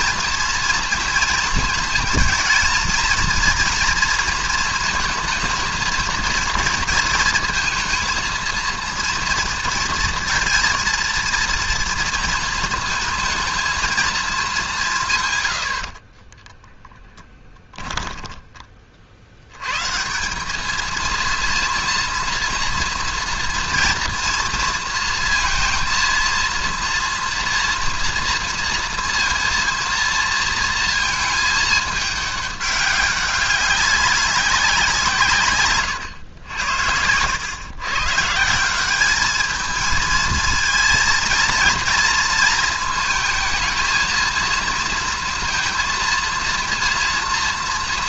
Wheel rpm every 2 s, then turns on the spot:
230, 230, 230, 230, 230, 230, 230, 180, 10, 20, 200, 230, 230, 230, 230, 230, 200, 180, 80, 170, 220, 220, 230, 230.
16-18